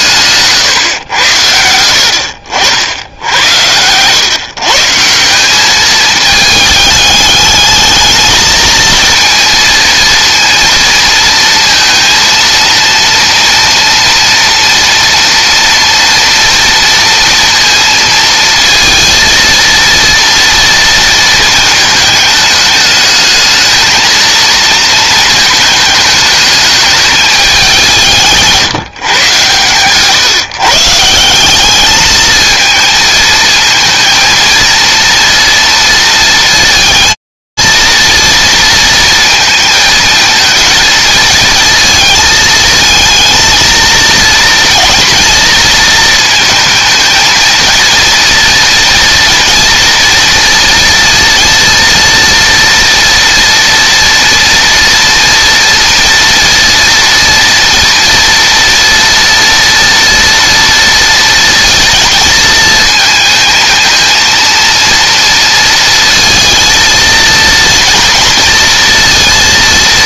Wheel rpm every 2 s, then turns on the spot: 130, 80, 150, 210, 220, 230, 230, 230, 230, 230, 230, 210, 230, 210, 160, 160, 230, 230, 230, 220, 230, 230, 230, 220, 230, 230, 230, 230, 230, 230, 230, 220, 230, 230, 230.
none